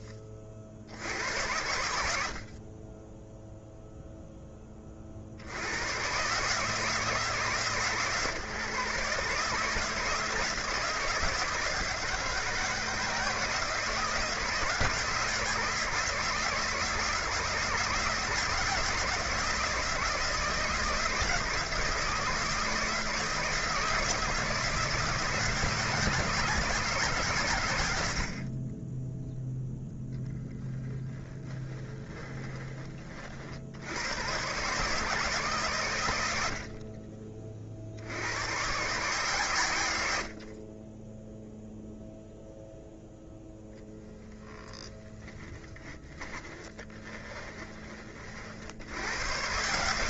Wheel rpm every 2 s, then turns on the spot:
70, 30, 30, 150, 140, 160, 160, 160, 160, 160, 160, 160, 160, 160, 20, 10, 30, 130, 30, 130, 20, 0, 10, 20, 90.
30-32 46-48